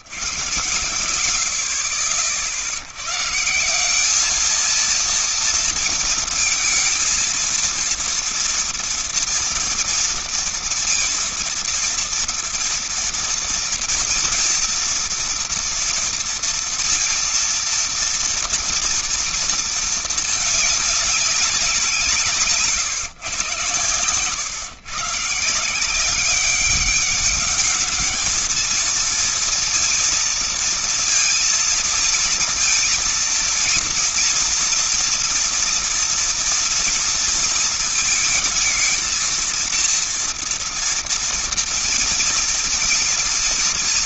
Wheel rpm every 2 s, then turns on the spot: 100, 60, 210, 220, 230, 230, 230, 230, 230, 240, 220, 160, 130, 190, 220, 230, 230, 230, 230, 220, 230, 230.
22-24